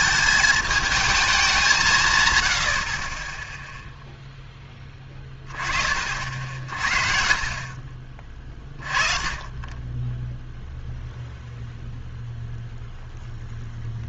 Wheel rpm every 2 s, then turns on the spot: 220, 90, 10, 50, 20, 0, 0.
none